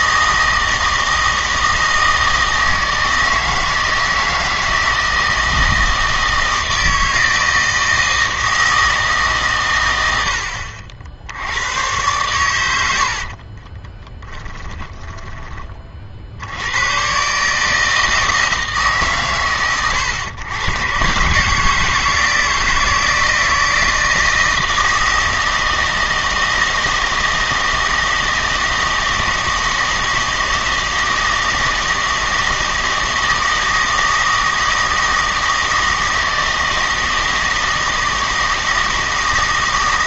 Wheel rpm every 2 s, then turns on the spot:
160, 160, 160, 160, 160, 60, 90, 10, 90, 150, 120, 160, 160, 160, 160, 160, 160, 160, 160, 160.
14-16